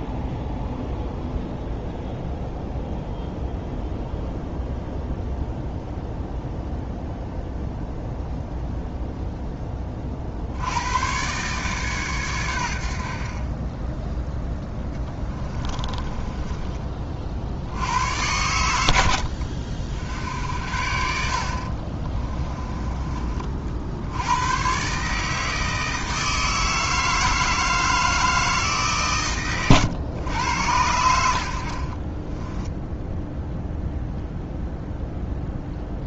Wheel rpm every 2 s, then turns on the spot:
0, 0, 0, 0, 0, 90, 80, 10, 20, 100, 60, 20, 130, 160, 150, 80, 10, 0.
14-16 32-34